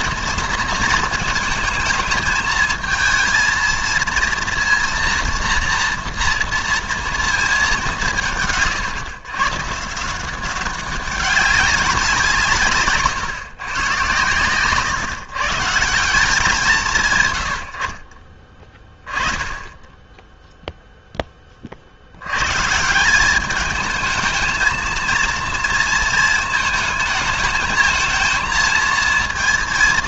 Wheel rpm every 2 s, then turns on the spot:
230, 220, 230, 230, 140, 190, 150, 130, 180, 20, 0, 140, 220, 230, 230.
14-16